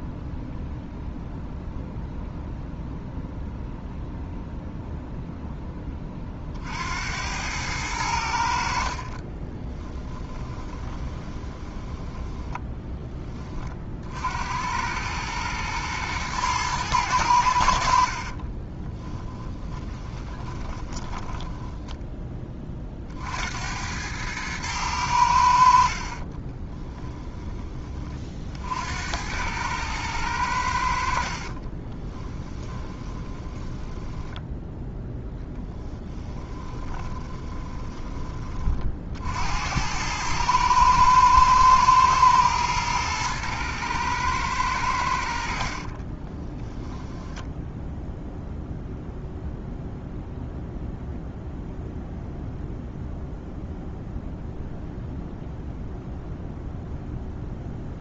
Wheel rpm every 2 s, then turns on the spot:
0, 0, 0, 70, 40, 20, 10, 100, 110, 20, 20, 50, 100, 20, 70, 70, 20, 10, 30, 40, 110, 110, 90, 10, 0, 0, 0, 0, 0.
8-12 18-22 26-28 32-34 36-38